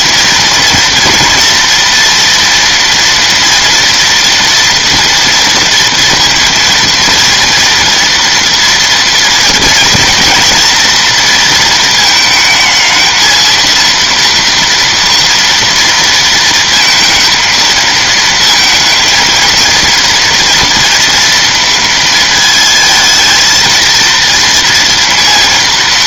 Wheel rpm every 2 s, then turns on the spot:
240, 240, 240, 230, 230, 230, 220, 230, 230, 230, 230, 220, 230.
none